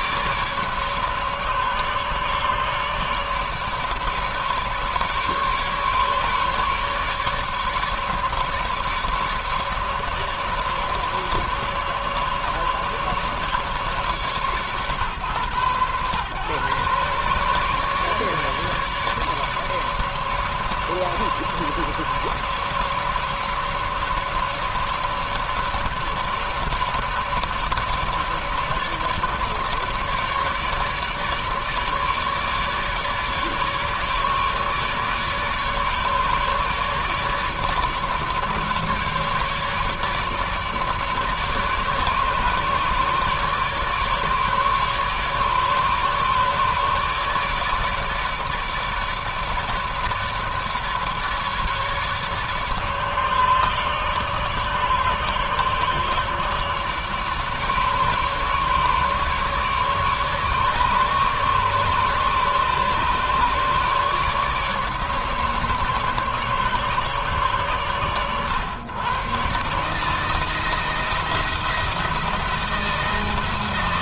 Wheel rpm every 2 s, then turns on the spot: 150, 150, 150, 150, 150, 150, 150, 120, 130, 150, 150, 150, 150, 150, 150, 150, 150, 150, 150, 150, 150, 150, 150, 150, 150, 150, 150, 150, 140, 150, 150, 150, 150, 140, 120, 170, 170.
none